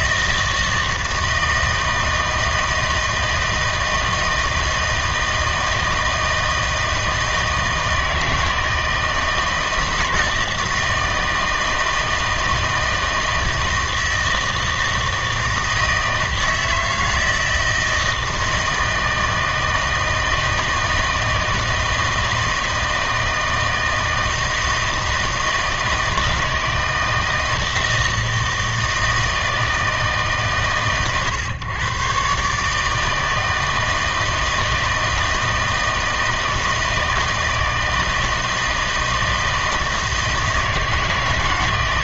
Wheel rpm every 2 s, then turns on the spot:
160, 160, 160, 160, 160, 160, 160, 160, 160, 160, 160, 160, 160, 160, 160, 130, 150, 160, 160, 160, 160.
none